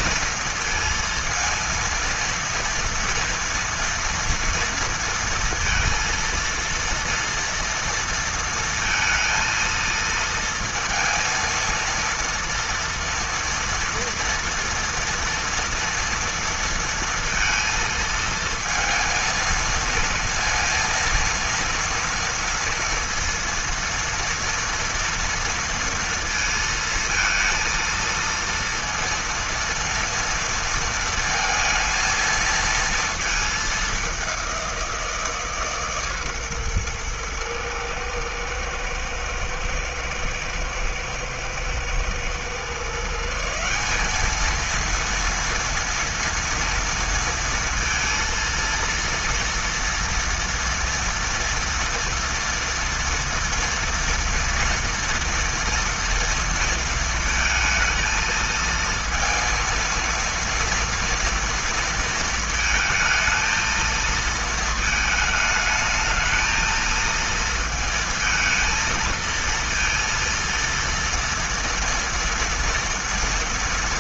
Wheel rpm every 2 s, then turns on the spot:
230, 230, 230, 230, 230, 230, 230, 230, 230, 220, 230, 230, 230, 230, 230, 230, 230, 180, 120, 110, 110, 140, 230, 230, 230, 230, 240, 230, 230, 230, 230, 220, 220, 220, 220, 230, 230.
none